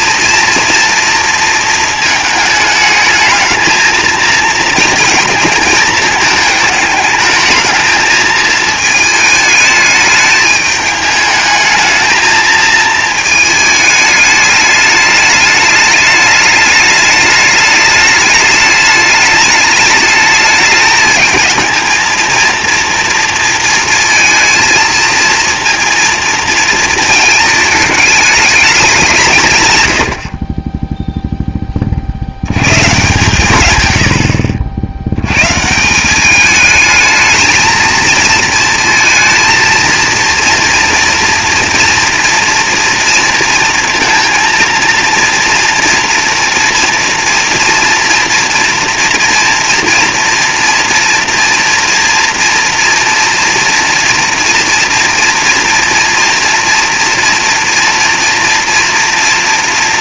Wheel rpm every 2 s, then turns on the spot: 230, 220, 230, 220, 220, 210, 220, 210, 210, 210, 220, 230, 230, 220, 210, 20, 110, 70, 220, 230, 230, 230, 230, 230, 230, 230, 230, 230, 230, 230.
none